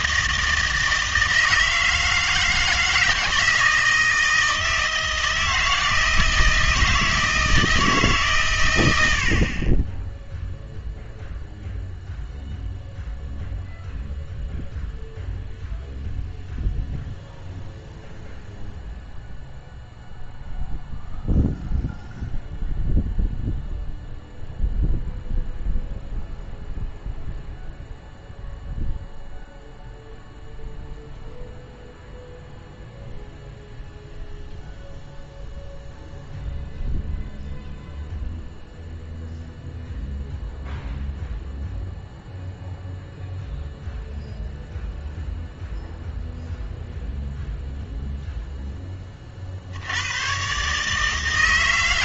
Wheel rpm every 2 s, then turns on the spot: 160, 160, 160, 160, 110, 0, 0, 0, 0, 0, 0, 0, 0, 0, 0, 0, 0, 0, 0, 0, 0, 0, 0, 0, 10, 140.
none